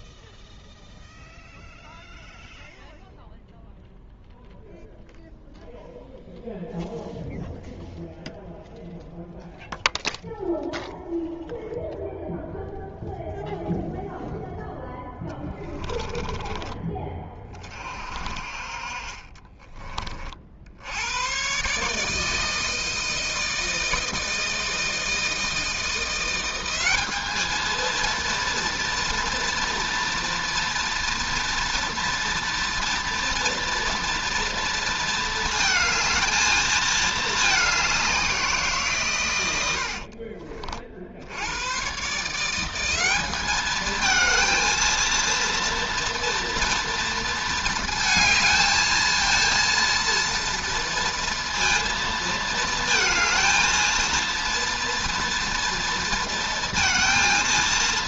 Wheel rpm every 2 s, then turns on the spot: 0, 0, 0, 0, 0, 0, 0, 10, 20, 40, 90, 160, 160, 190, 240, 240, 230, 220, 220, 150, 50, 180, 230, 240, 220, 230, 220, 230, 230.
none